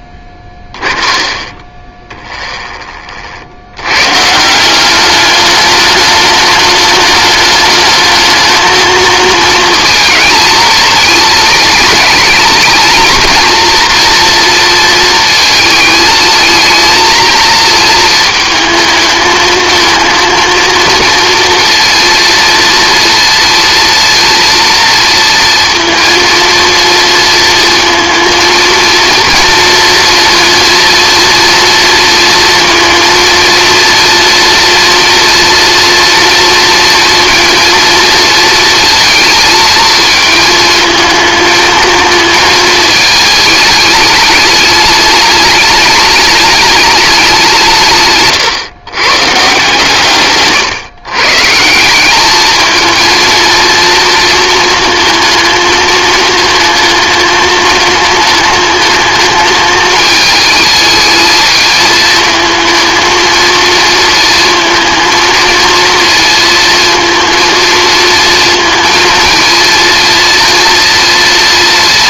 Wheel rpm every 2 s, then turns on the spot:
20, 40, 190, 210, 220, 220, 220, 230, 230, 220, 230, 230, 230, 230, 230, 230, 230, 230, 230, 230, 220, 220, 210, 210, 140, 130, 220, 230, 220, 210, 220, 220, 220, 230, 220, 230.
0-2